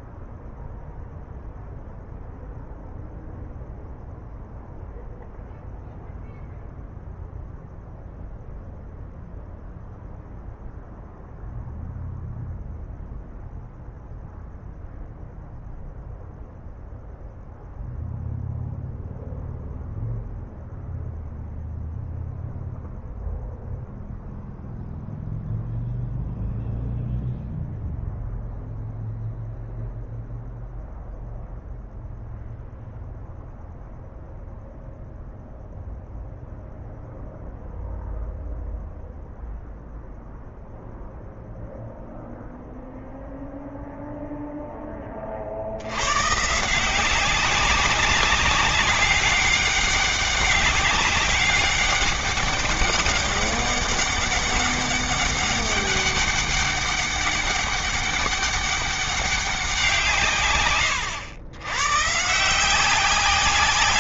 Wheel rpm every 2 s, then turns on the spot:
0, 0, 0, 0, 0, 0, 0, 0, 0, 0, 0, 0, 0, 0, 0, 0, 0, 0, 0, 0, 0, 0, 30, 180, 200, 200, 200, 200, 200, 200, 110, 180.
none